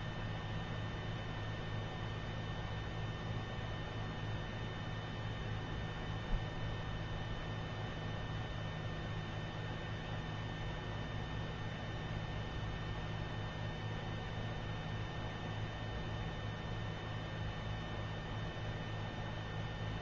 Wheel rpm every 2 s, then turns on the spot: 0, 0, 0, 0, 0, 0, 0, 0, 0, 0.
none